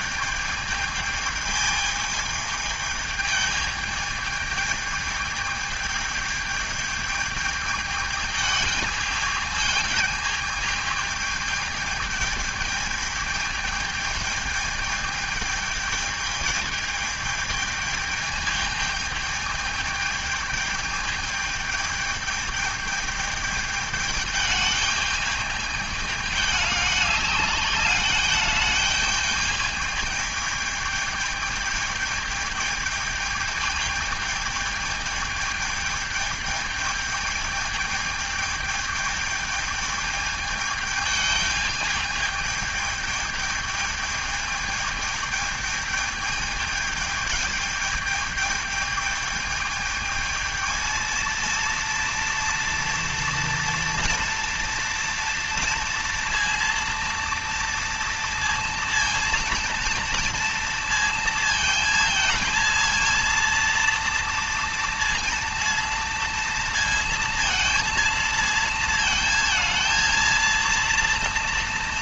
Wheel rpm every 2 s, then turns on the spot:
210, 210, 210, 210, 210, 210, 210, 210, 210, 210, 210, 210, 210, 200, 210, 210, 210, 210, 220, 220, 210, 210, 210, 210, 220, 220, 230, 230, 230, 230, 230, 230, 230, 230, 230, 230.
none